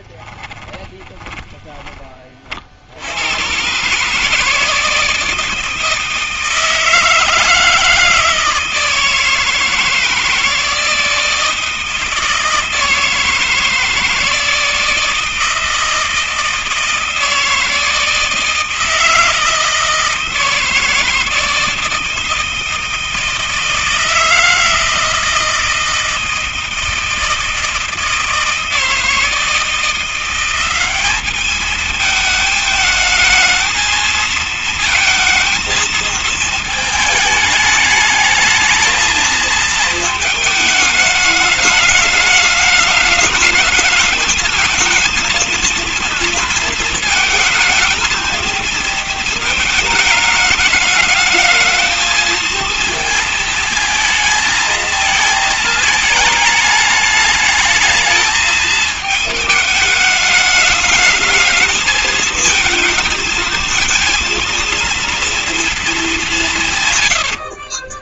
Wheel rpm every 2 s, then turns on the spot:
20, 40, 150, 160, 160, 160, 160, 160, 160, 160, 160, 160, 160, 160, 160, 180, 220, 220, 220, 220, 220, 210, 220, 230, 230, 220, 220, 220, 220, 220, 210, 220, 230, 170.
0-2